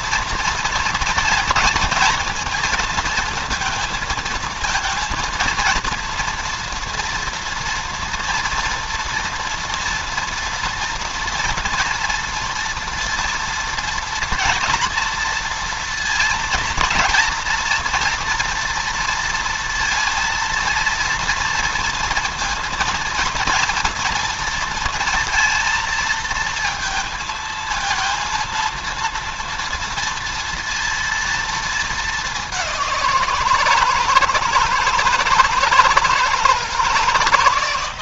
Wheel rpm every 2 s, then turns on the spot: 230, 230, 230, 230, 230, 230, 230, 230, 230, 230, 230, 230, 230, 220, 230, 230, 190, 160, 160.
none